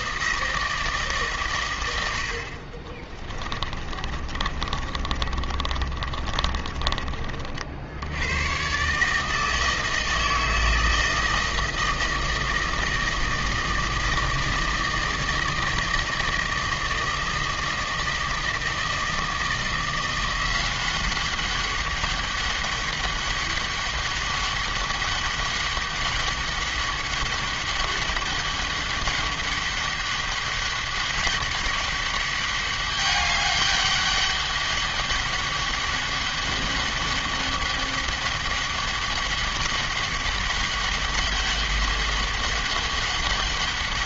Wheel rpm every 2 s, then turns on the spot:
160, 40, 40, 30, 130, 160, 160, 160, 160, 160, 190, 200, 200, 200, 200, 190, 200, 200, 200, 200, 200, 200.
2-8